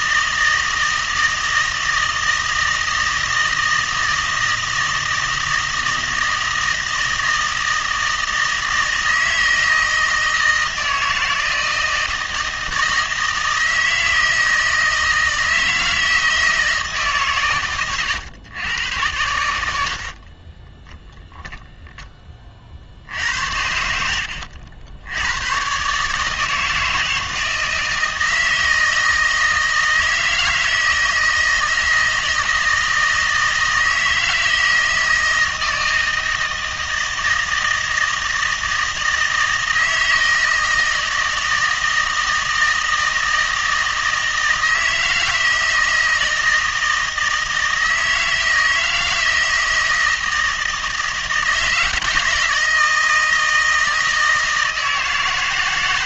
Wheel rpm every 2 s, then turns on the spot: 160, 160, 160, 160, 160, 160, 160, 160, 160, 100, 10, 50, 80, 160, 160, 160, 160, 160, 160, 160, 160, 160, 160, 160, 160, 160, 160, 160.
none